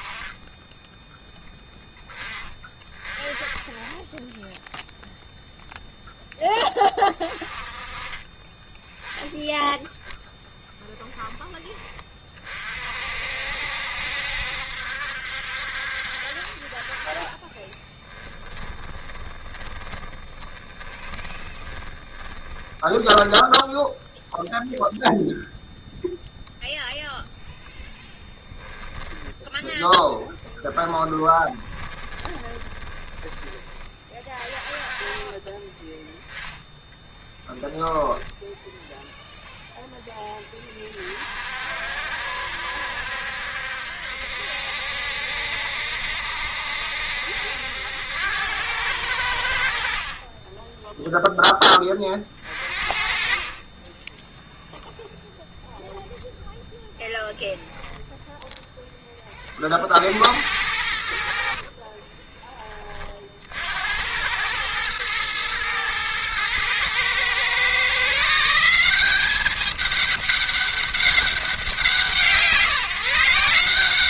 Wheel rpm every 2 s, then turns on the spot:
10, 30, 0, 20, 20, 10, 40, 70, 40, 10, 20, 20, 0, 0, 10, 20, 20, 30, 10, 0, 20, 70, 70, 70, 90, 10, 40, 0, 0, 10, 80, 20, 100, 120, 180, 200, 160.
18-24 28-34 36-38